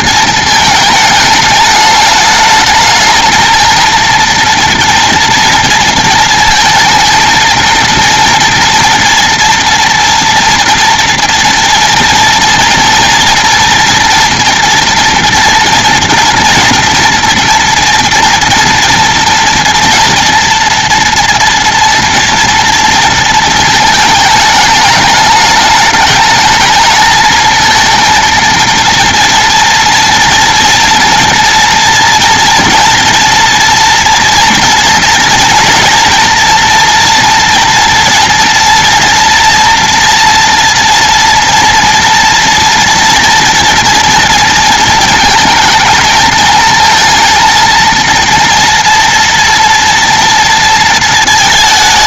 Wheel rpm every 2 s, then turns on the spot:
220, 220, 230, 220, 240, 230, 230, 230, 230, 230, 240, 230, 210, 220, 230, 230, 230, 230, 230, 240, 230, 230, 230, 220, 230, 230.
none